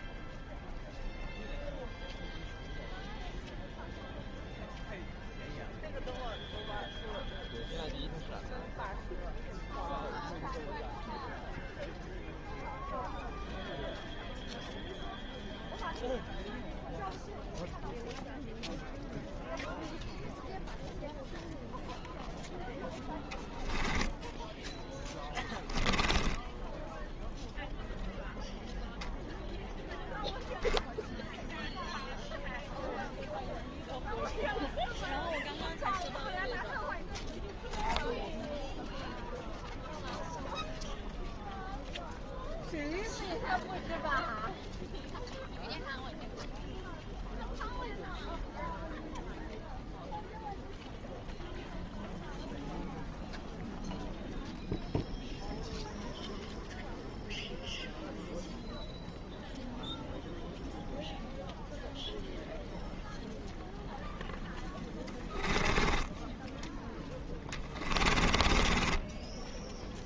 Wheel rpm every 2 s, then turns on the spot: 0, 0, 0, 0, 0, 0, 0, 0, 0, 0, 0, 0, 10, 10, 0, 0, 0, 0, 0, 0, 0, 0, 0, 0, 0, 0, 0, 0, 0, 0, 0, 0, 10, 10, 10.
26-28 64-66 68-70